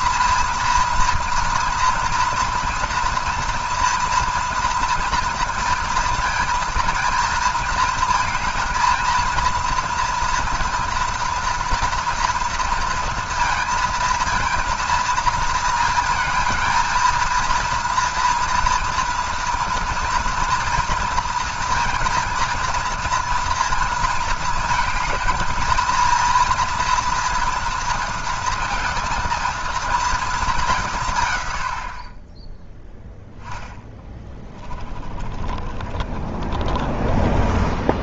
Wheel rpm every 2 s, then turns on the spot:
230, 230, 230, 230, 220, 230, 230, 230, 230, 230, 230, 230, 220, 230, 230, 200, 10, 20, 30.
34-38